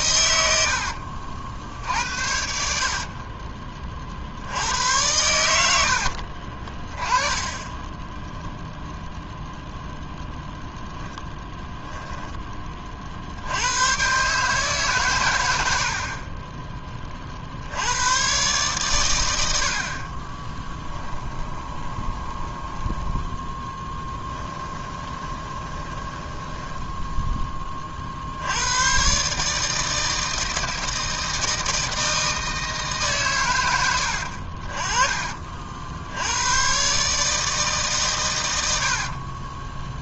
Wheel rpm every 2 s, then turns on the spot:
70, 70, 90, 20, 0, 0, 40, 130, 20, 120, 10, 10, 20, 10, 110, 160, 150, 40, 130, 70.
0-2 20-22 24-28 38-40